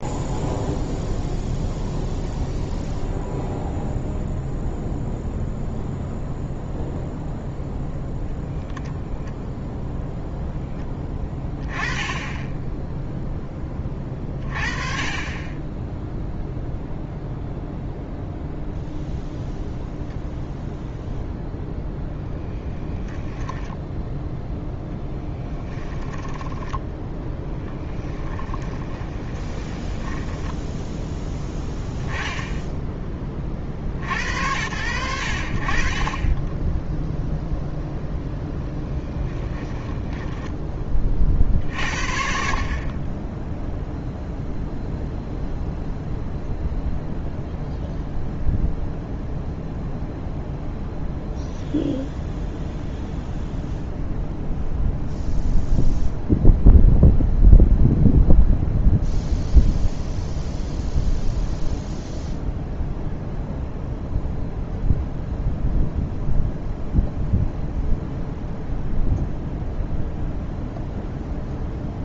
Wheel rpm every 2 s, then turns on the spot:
0, 0, 0, 0, 0, 0, 10, 30, 0, 0, 0, 20, 0, 10, 20, 10, 10, 90, 10, 0, 10, 40, 0, 0, 0, 0, 0, 0, 0, 0, 0, 0, 0, 0, 0, 0.
26-32